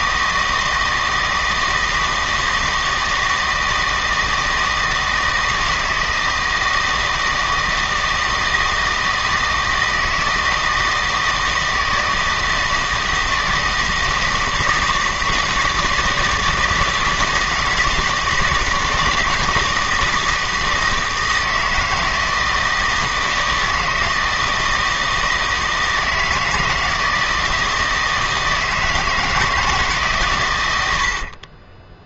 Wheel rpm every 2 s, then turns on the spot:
160, 160, 160, 160, 160, 160, 160, 160, 160, 160, 160, 160, 160, 160, 170, 100.
none